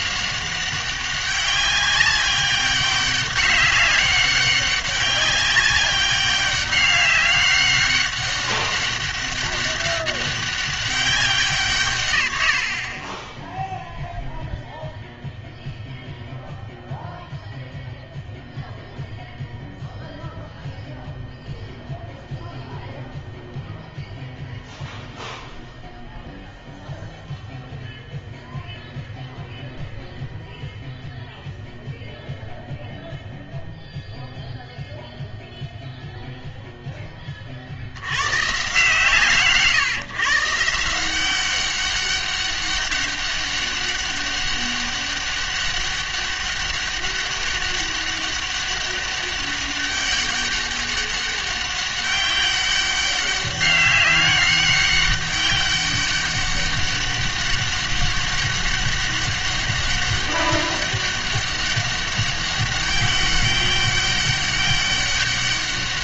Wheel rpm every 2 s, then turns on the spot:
190, 200, 190, 200, 200, 190, 70, 0, 0, 0, 0, 0, 0, 0, 0, 0, 0, 0, 0, 140, 160, 200, 200, 200, 200, 200, 200, 190, 200, 200, 200, 190, 200.
12-14